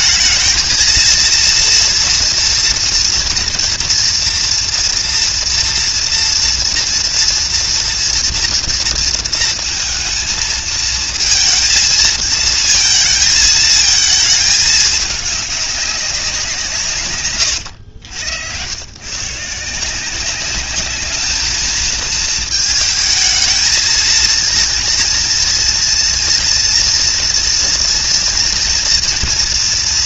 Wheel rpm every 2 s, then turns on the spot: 230, 230, 230, 230, 230, 230, 230, 210, 170, 110, 210, 220, 230, 240, 230.
none